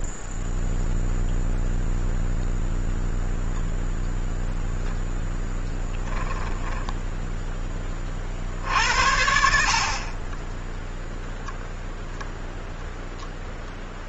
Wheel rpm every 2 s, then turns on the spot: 0, 0, 0, 10, 30, 50, 0.
6-8